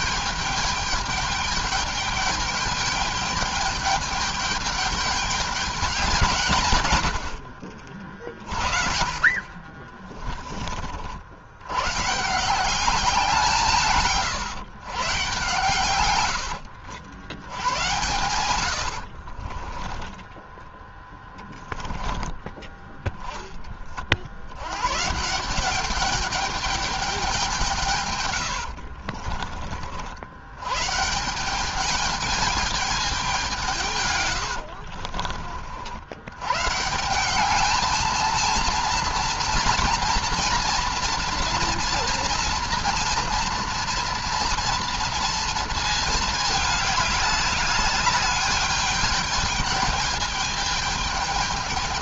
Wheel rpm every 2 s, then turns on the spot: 210, 210, 210, 130, 30, 30, 170, 130, 90, 90, 10, 10, 100, 210, 100, 110, 210, 90, 140, 230, 230, 230, 230, 210, 210, 220.
16-20 28-30 34-36